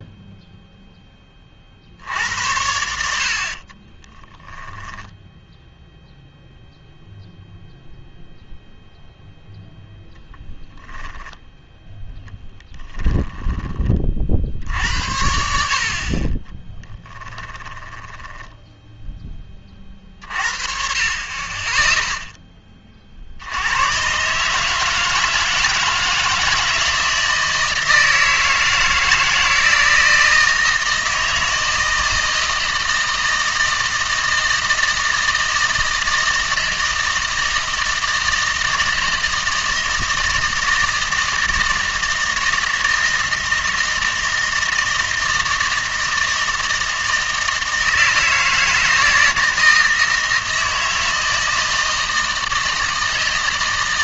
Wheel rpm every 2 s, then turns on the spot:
0, 80, 10, 0, 0, 10, 10, 60, 20, 10, 40, 10, 150, 160, 160, 160, 160, 160, 160, 160, 160, 160, 160, 160, 160, 160, 160.
12-14 16-20